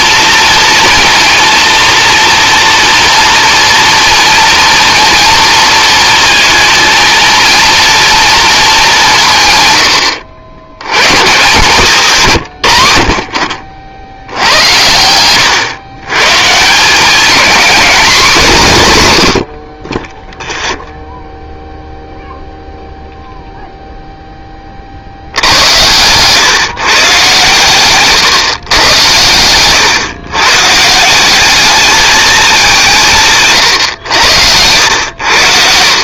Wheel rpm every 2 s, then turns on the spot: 230, 240, 230, 230, 220, 90, 110, 90, 170, 160, 0, 0, 40, 130, 120, 150, 200, 90.
28-30